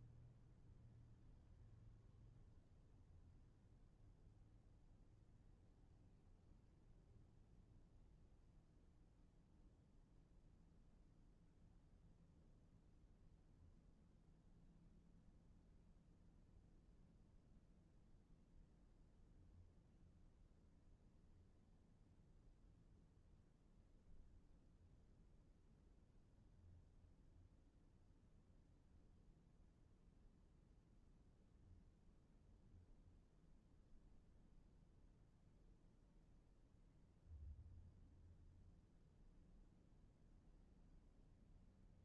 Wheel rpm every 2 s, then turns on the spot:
0, 0, 0, 0, 0, 0, 0, 0, 0, 0, 0, 0, 0, 0, 0, 0, 0, 0, 0, 0, 0.
none